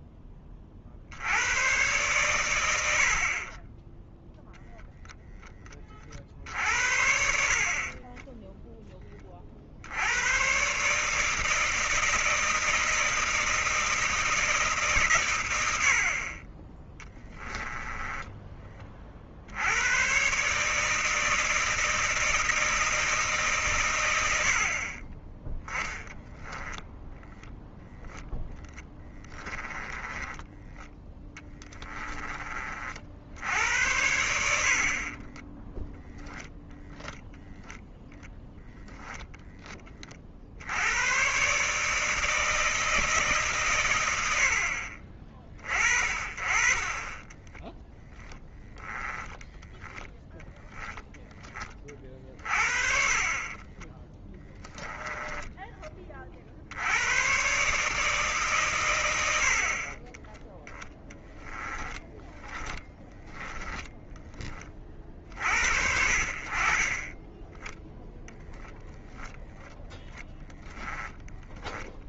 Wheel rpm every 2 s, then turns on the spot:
50, 80, 0, 60, 20, 140, 160, 130, 20, 30, 150, 160, 40, 0, 10, 10, 50, 40, 0, 10, 90, 160, 60, 30, 10, 10, 40, 20, 90, 110, 10, 10, 50, 30, 0, 0.
6-8 16-18 28-30 34-36 46-48 52-56 62-64